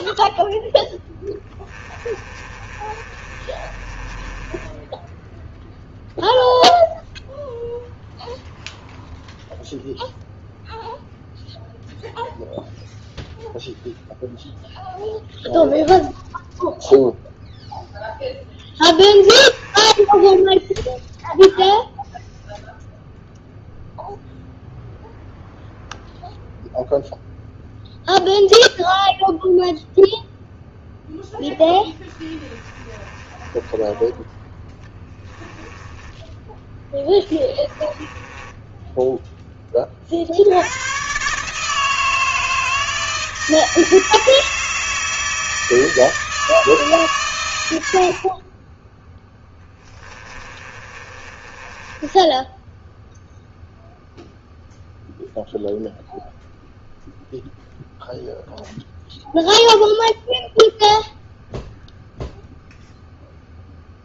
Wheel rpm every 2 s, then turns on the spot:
0, 30, 10, 0, 0, 0, 0, 0, 0, 20, 10, 0, 0, 0, 0, 0, 10, 10, 10, 10, 90, 160, 160, 150, 20, 30, 10, 0, 0, 0, 0, 0.
2-6 18-22 32-40 50-54